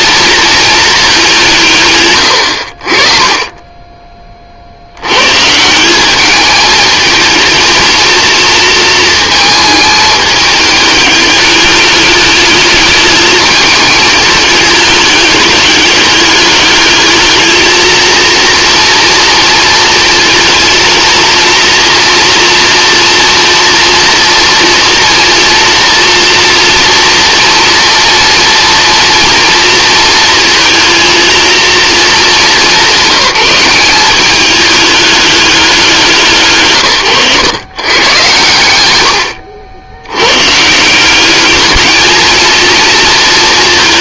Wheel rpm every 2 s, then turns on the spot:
210, 40, 90, 220, 230, 210, 210, 210, 210, 230, 220, 230, 230, 230, 230, 230, 170, 210, 130, 90, 190, 230.
none